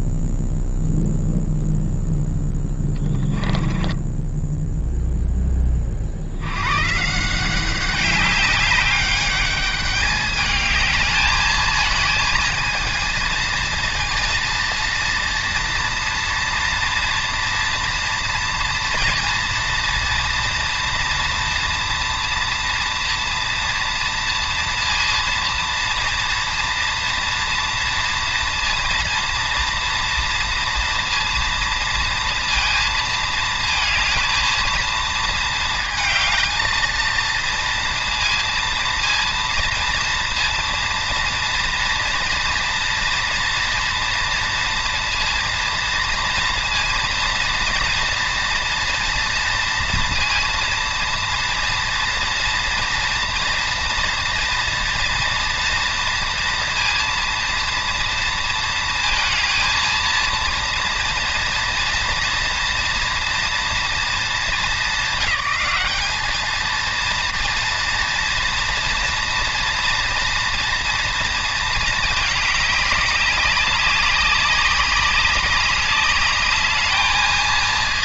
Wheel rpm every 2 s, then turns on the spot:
0, 10, 10, 90, 200, 210, 230, 230, 230, 230, 230, 230, 230, 230, 230, 230, 230, 230, 220, 230, 230, 230, 230, 240, 230, 230, 230, 240, 230, 230, 230, 230, 210, 210, 230, 240, 210, 200, 210.
4-6